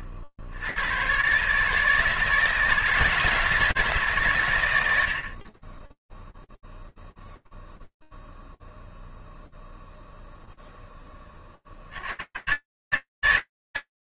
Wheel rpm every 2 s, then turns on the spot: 90, 160, 100, 0, 0, 10, 150.
none